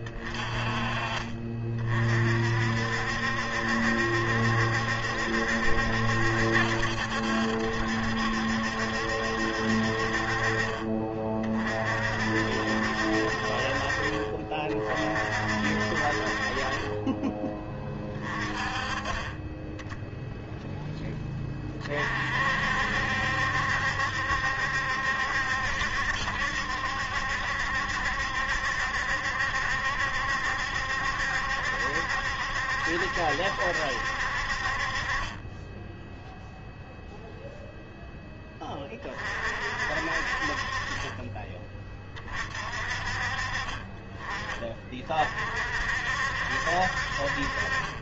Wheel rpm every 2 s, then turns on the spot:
30, 60, 70, 70, 70, 40, 60, 40, 30, 30, 10, 60, 70, 70, 70, 70, 70, 40, 0, 20, 30, 40, 30, 50.
none